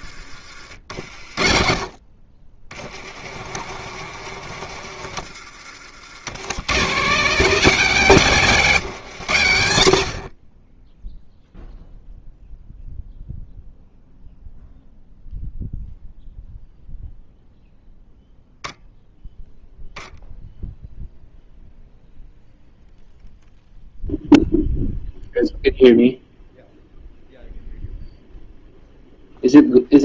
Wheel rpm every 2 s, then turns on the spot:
40, 50, 70, 180, 70, 0, 0, 0, 0, 0, 0, 0, 0, 0, 0.
0-4 8-10